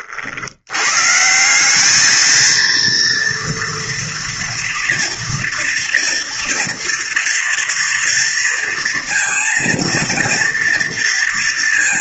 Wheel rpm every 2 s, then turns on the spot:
90, 230, 230, 230, 230, 230.
none